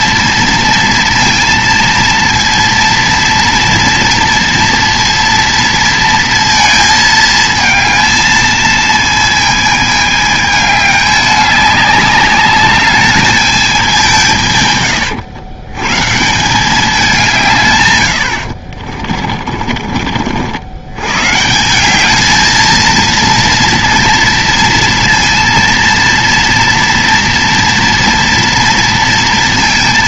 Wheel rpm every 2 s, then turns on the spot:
230, 230, 230, 230, 220, 210, 200, 150, 170, 60, 70, 220, 230, 230, 230.
18-20